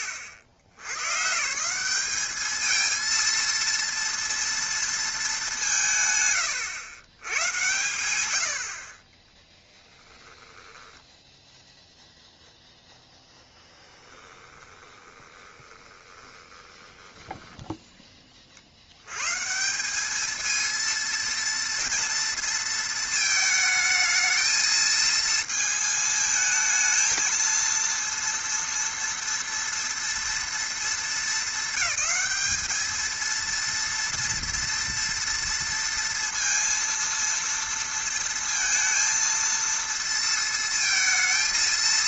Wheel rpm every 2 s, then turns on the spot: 100, 220, 220, 80, 40, 10, 0, 20, 10, 90, 230, 230, 220, 220, 230, 230, 220, 230, 230, 230, 230.
10-12 14-18